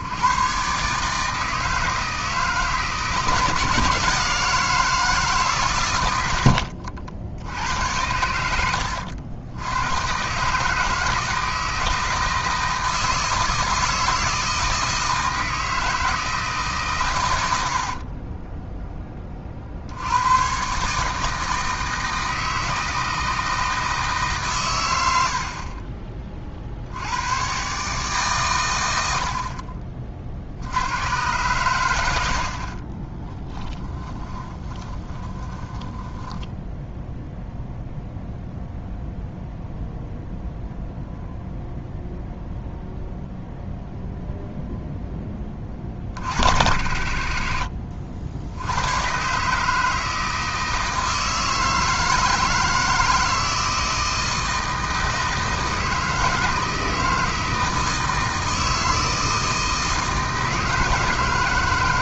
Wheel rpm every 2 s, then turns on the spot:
130, 160, 160, 80, 90, 150, 160, 160, 140, 10, 140, 160, 120, 60, 110, 90, 50, 20, 10, 0, 0, 0, 0, 50, 80, 160, 160, 160, 160, 160, 160.
6-10 32-36